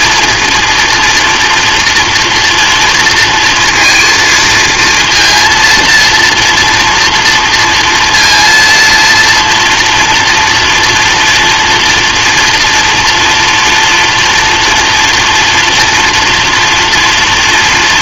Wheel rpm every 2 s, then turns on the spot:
230, 230, 230, 230, 230, 240, 230, 230, 230.
none